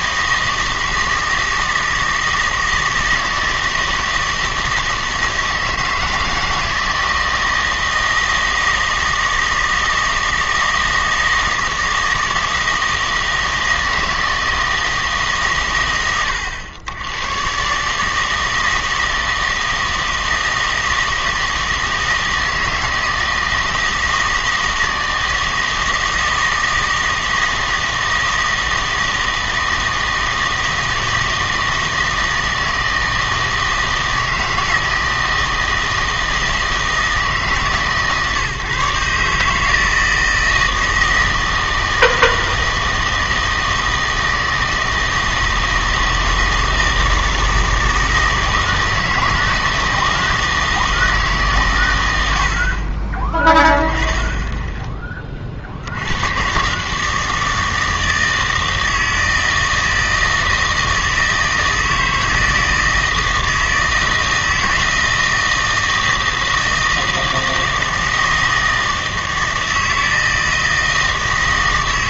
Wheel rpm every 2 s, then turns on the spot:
160, 160, 160, 160, 160, 160, 160, 160, 100, 150, 160, 160, 160, 160, 160, 160, 160, 160, 160, 150, 160, 160, 160, 160, 160, 160, 100, 10, 100, 160, 160, 160, 160, 160, 160, 160.
none